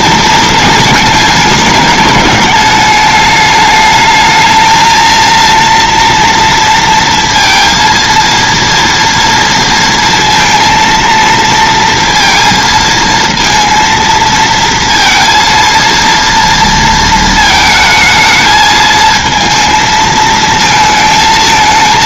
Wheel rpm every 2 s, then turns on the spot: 220, 210, 220, 230, 230, 230, 230, 230, 230, 220, 220.
none